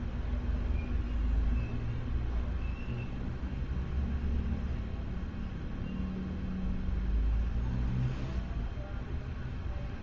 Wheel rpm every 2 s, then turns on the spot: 0, 0, 0, 0, 0.
none